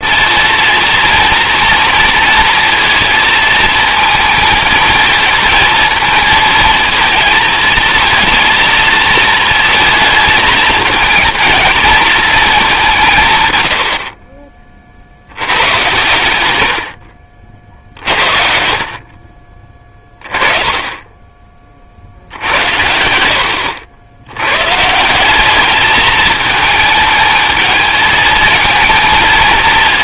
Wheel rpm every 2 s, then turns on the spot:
220, 230, 220, 220, 230, 220, 220, 40, 100, 50, 30, 70, 100, 220, 220.
none